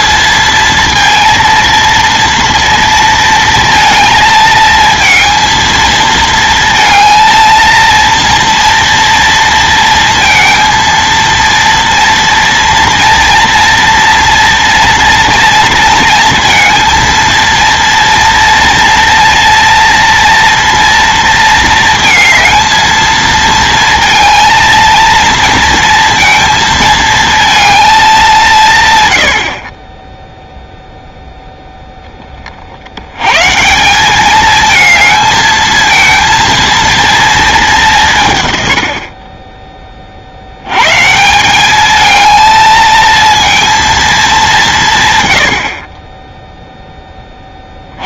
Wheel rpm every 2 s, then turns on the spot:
230, 230, 220, 230, 230, 230, 230, 230, 230, 230, 230, 220, 230, 230, 160, 0, 50, 220, 230, 110, 90, 220, 180, 0.
none